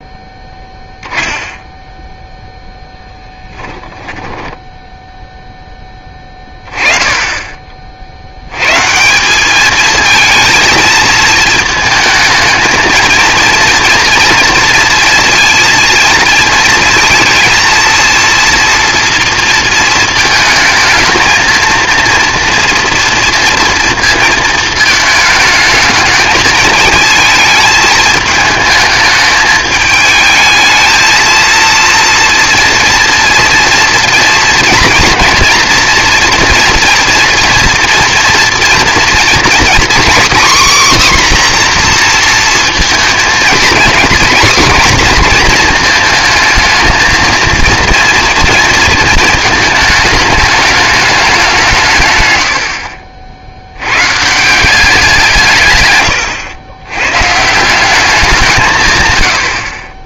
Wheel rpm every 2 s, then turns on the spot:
0, 10, 0, 10, 140, 220, 220, 230, 230, 230, 220, 230, 220, 220, 210, 220, 230, 230, 230, 230, 260, 230, 250, 220, 230, 210, 60, 190, 110, 150.
none